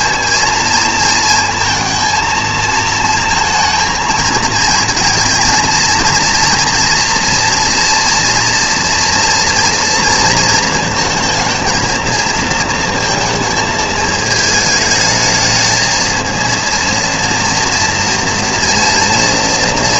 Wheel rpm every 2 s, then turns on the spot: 230, 220, 220, 230, 240, 230, 230, 220, 230, 230.
none